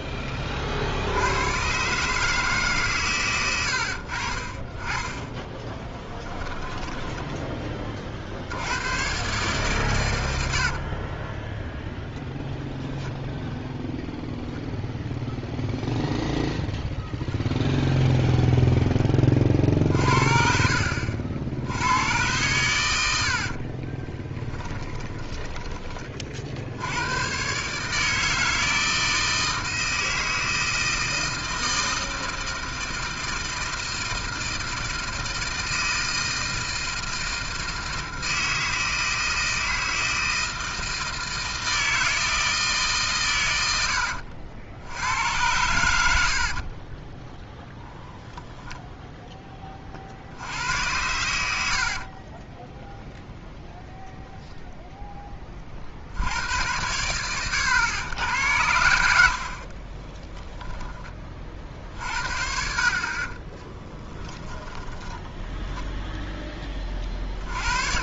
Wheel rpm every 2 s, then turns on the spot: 30, 130, 30, 10, 60, 100, 0, 0, 10, 0, 60, 110, 20, 50, 160, 160, 160, 160, 160, 160, 160, 160, 70, 40, 0, 70, 20, 0, 100, 90, 10, 60, 20, 20.
6-8 10-12 24-26 46-48 50-52 62-64